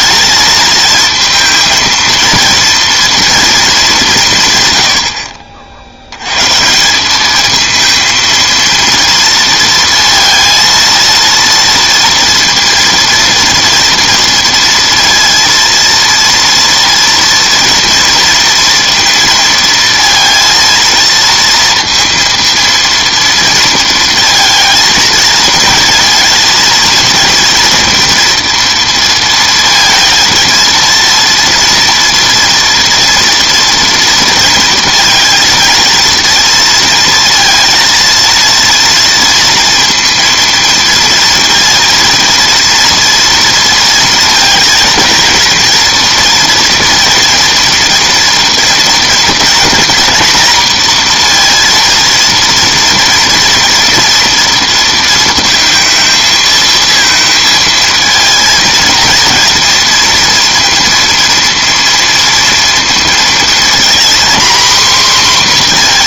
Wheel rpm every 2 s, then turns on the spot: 220, 230, 130, 150, 230, 230, 230, 230, 230, 230, 230, 230, 220, 230, 230, 230, 230, 230, 230, 230, 230, 230, 230, 230, 230, 240, 230, 230, 220, 230, 230, 230, 250.
none